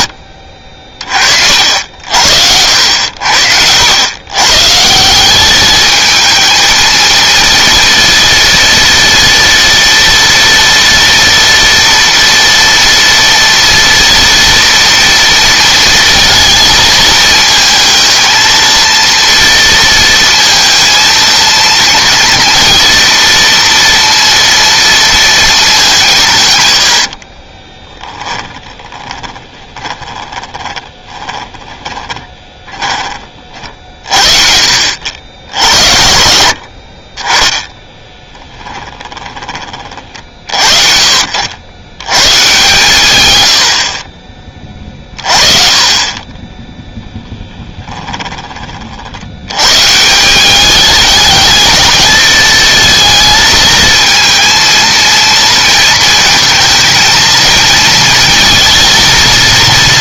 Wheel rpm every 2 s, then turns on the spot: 60, 70, 150, 230, 230, 230, 230, 230, 220, 230, 220, 230, 230, 100, 30, 20, 20, 60, 50, 10, 60, 120, 30, 10, 50, 210, 230, 230, 220, 230.
26-32 38-40